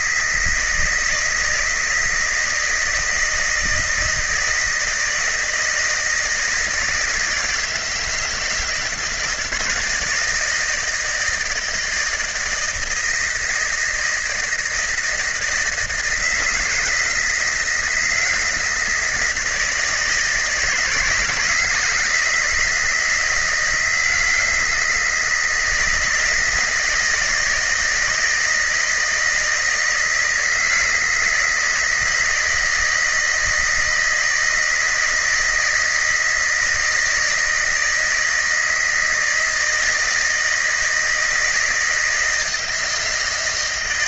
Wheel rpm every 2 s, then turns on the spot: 160, 160, 160, 160, 160, 160, 160, 170, 160, 160, 160, 170, 160, 160, 160, 160, 160, 170, 160, 160, 160, 160.
none